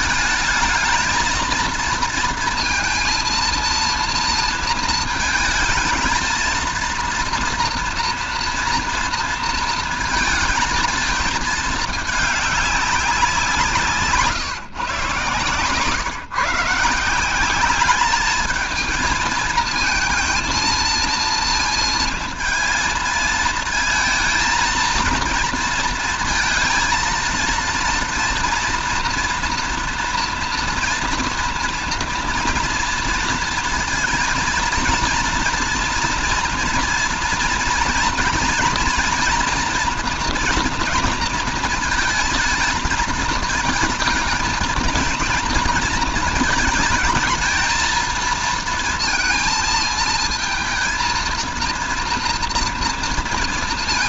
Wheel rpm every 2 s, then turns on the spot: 220, 230, 230, 220, 230, 230, 200, 140, 160, 220, 230, 230, 220, 230, 240, 240, 230, 230, 230, 230, 230, 220, 230, 220, 230, 220, 230.
none